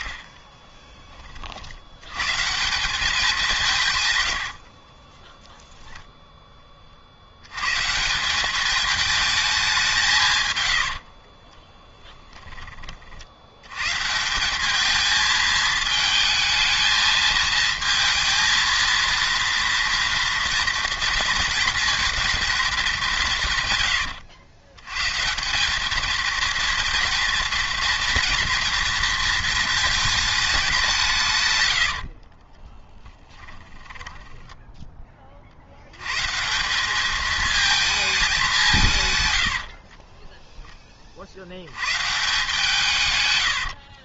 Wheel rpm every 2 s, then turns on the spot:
20, 170, 70, 30, 200, 100, 30, 200, 220, 230, 230, 220, 100, 220, 230, 210, 20, 10, 180, 170, 10, 160.
4-6 32-34